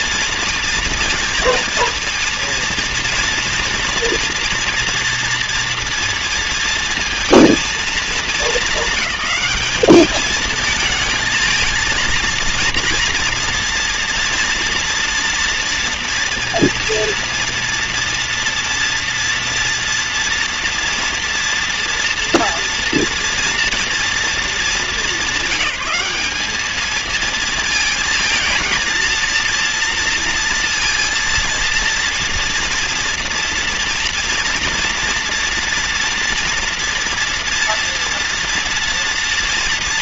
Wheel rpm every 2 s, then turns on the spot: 230, 230, 230, 230, 220, 220, 230, 230, 230, 230, 230, 230, 210, 210, 230, 230, 230, 230, 230, 230.
none